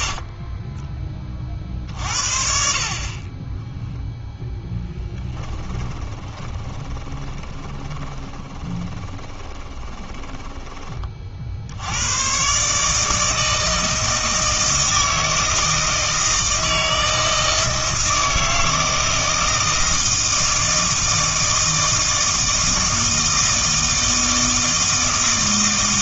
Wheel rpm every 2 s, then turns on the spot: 20, 50, 10, 20, 20, 20, 140, 160, 160, 160, 160, 160, 160.
0-2 6-10